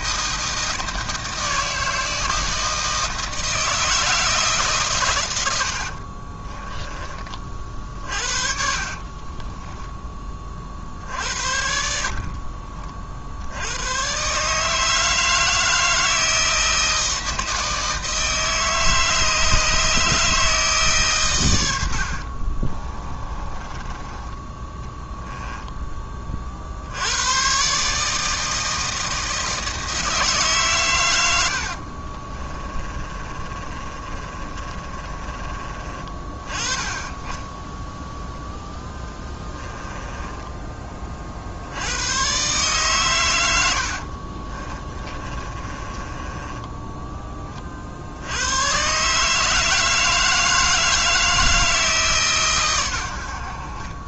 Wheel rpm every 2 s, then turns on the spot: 160, 160, 150, 20, 40, 50, 40, 150, 160, 160, 150, 40, 20, 50, 160, 130, 30, 30, 20, 0, 10, 120, 30, 10, 110, 160, 120.
6-10 22-24 32-36 40-42 44-48